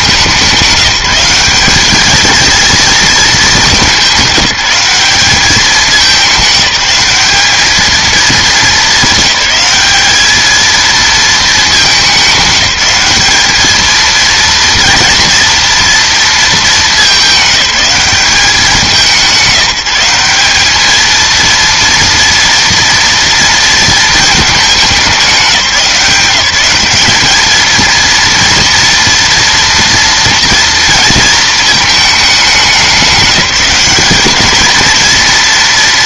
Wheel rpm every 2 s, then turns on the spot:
180, 230, 190, 210, 220, 220, 200, 230, 220, 190, 200, 230, 210, 200, 230, 230, 190, 220.
none